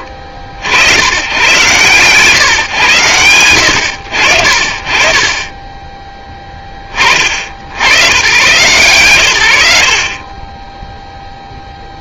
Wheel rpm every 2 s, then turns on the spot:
60, 130, 50, 20, 110, 0.
none